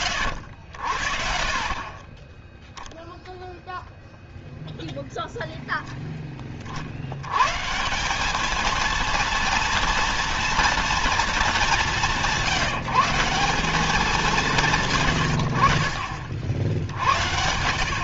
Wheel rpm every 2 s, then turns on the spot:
90, 0, 0, 60, 220, 230, 170, 160, 70.
none